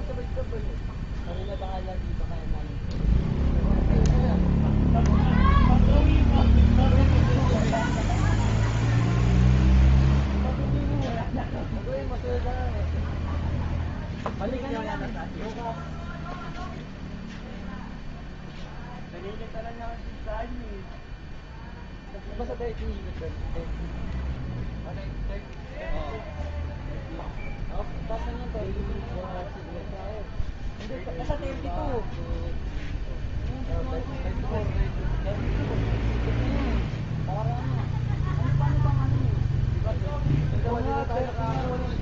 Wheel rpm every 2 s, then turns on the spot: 0, 0, 0, 0, 0, 0, 0, 0, 0, 0, 0, 0, 0, 0, 0, 0, 0, 0, 0, 0, 0.
none